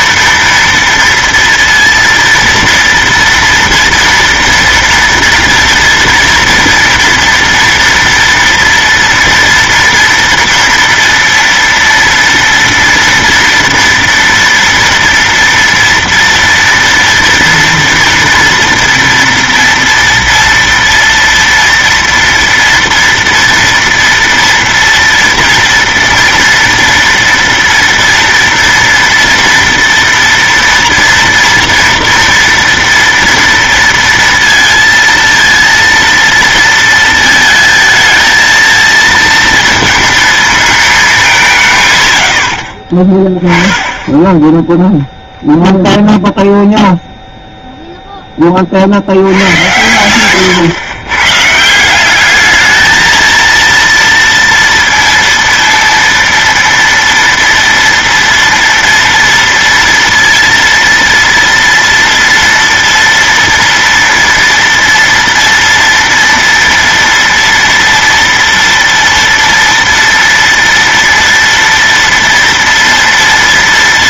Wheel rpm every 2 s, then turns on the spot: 230, 230, 230, 230, 230, 230, 230, 230, 230, 230, 230, 240, 230, 230, 230, 230, 230, 230, 230, 230, 220, 70, 10, 0, 30, 120, 220, 230, 230, 230, 230, 230, 230, 230, 230, 230, 230.
none